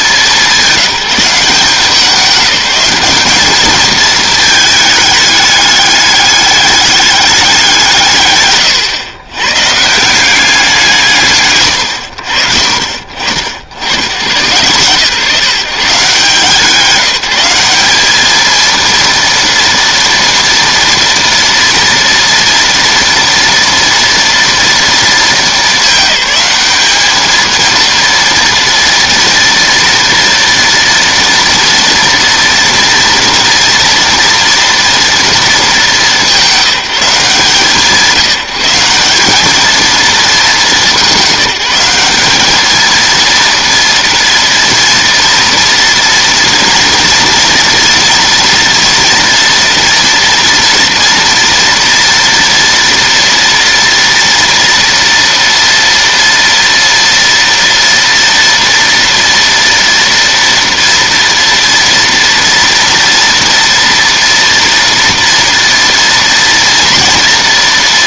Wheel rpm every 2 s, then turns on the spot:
190, 190, 220, 200, 150, 180, 50, 120, 170, 230, 240, 230, 230, 210, 230, 240, 230, 230, 180, 170, 200, 220, 230, 230, 230, 230, 230, 230, 230, 230, 230, 230, 240, 230.
none